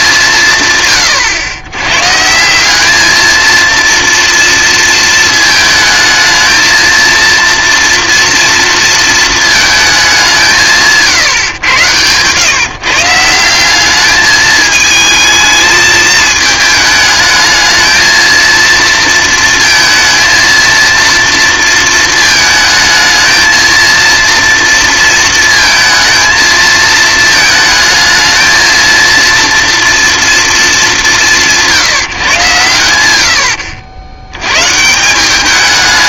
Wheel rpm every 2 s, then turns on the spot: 150, 180, 230, 230, 230, 170, 150, 210, 220, 230, 230, 220, 230, 220, 220, 220, 130, 110.
none